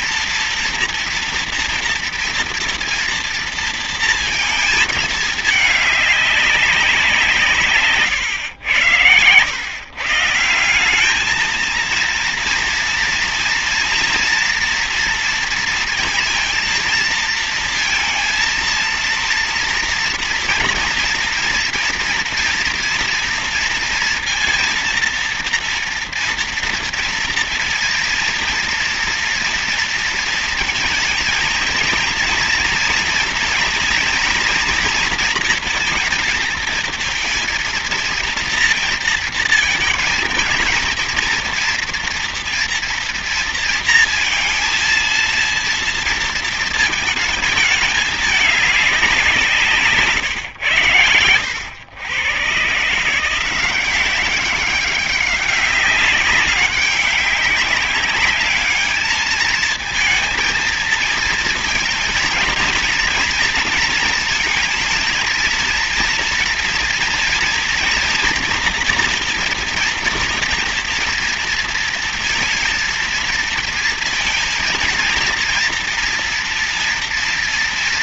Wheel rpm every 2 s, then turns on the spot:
230, 230, 230, 200, 110, 160, 230, 230, 230, 230, 230, 230, 230, 230, 230, 230, 230, 230, 230, 230, 220, 230, 230, 220, 210, 110, 130, 190, 190, 200, 220, 230, 230, 240, 230, 230, 230, 230, 230.
none